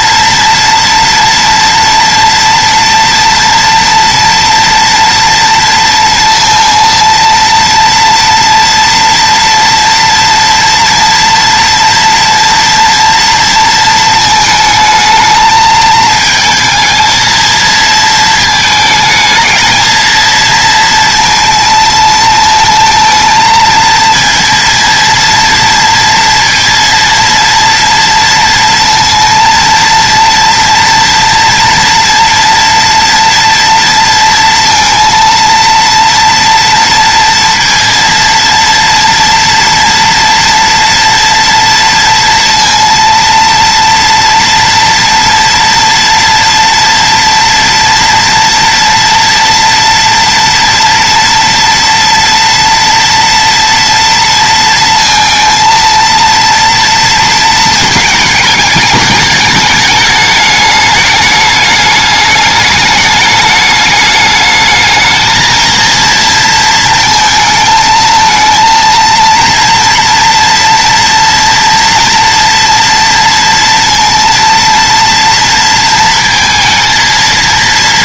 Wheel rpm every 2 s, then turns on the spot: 230, 240, 230, 230, 230, 240, 240, 220, 220, 220, 230, 220, 230, 230, 230, 230, 240, 230, 230, 230, 230, 230, 230, 230, 230, 230, 230, 230, 230, 220, 210, 210, 220, 230, 230, 230, 230, 230, 230.
none